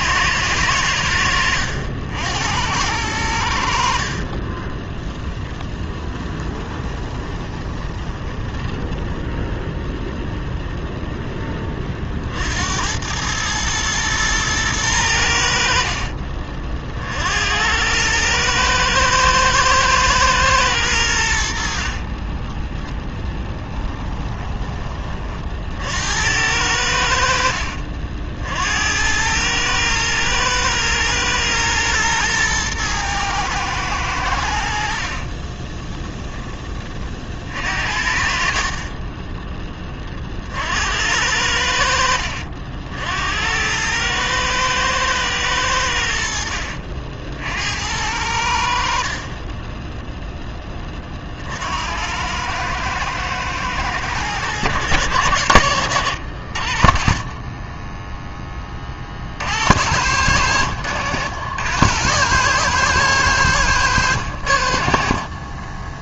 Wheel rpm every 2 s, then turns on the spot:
90, 90, 20, 10, 10, 0, 70, 110, 40, 110, 110, 10, 20, 80, 70, 110, 110, 70, 20, 50, 60, 60, 110, 70, 70, 10, 110, 110, 60, 20, 100, 120, 60.
4-10 38-40